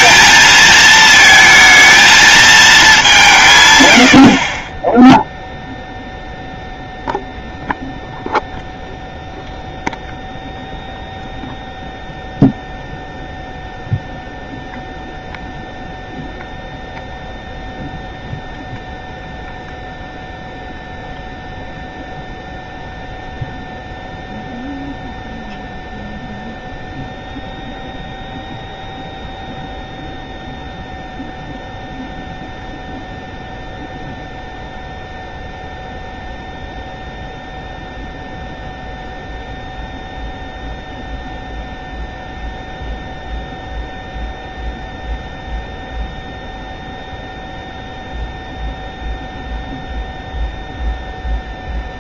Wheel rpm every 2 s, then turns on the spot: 220, 210, 20, 0, 0, 0, 0, 0, 0, 0, 0, 0, 0, 0, 0, 0, 0, 0, 0, 0, 0, 0, 0, 0, 0, 0.
none